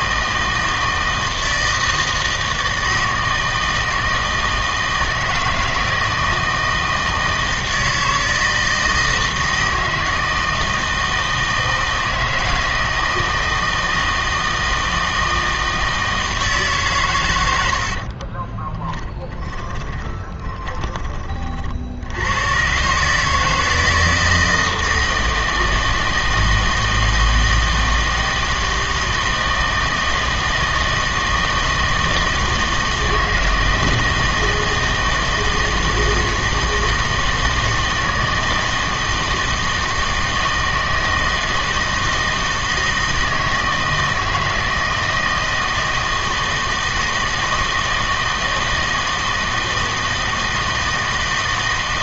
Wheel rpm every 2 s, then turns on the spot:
160, 160, 160, 160, 160, 160, 160, 160, 140, 10, 10, 120, 160, 160, 160, 160, 160, 160, 160, 160, 160, 160, 160, 160, 160, 160.
18-20